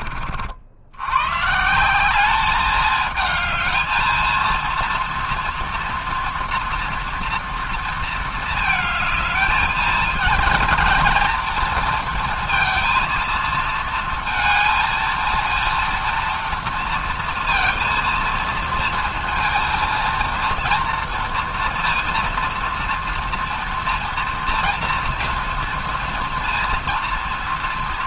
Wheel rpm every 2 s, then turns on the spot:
50, 210, 230, 230, 220, 220, 230, 230, 230, 230, 230, 230, 230, 230.
none